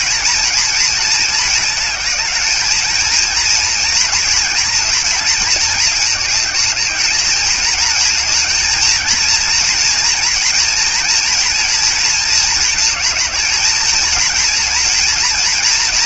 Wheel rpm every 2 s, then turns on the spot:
230, 220, 230, 210, 220, 230, 220, 230.
none